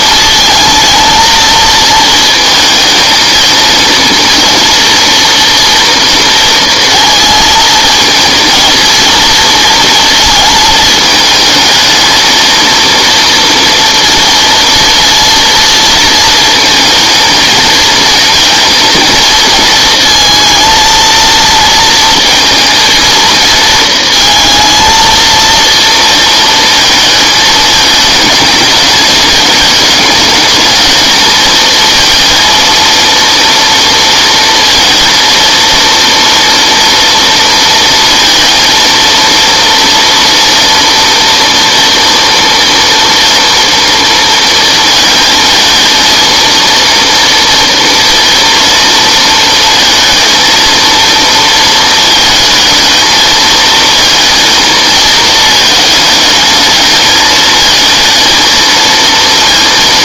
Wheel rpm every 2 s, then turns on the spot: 220, 220, 230, 230, 230, 220, 230, 240, 220, 230, 230, 230, 230, 230, 220, 210, 230, 230, 230, 230, 230, 240, 230, 230, 230, 220, 230, 230, 220, 230.
none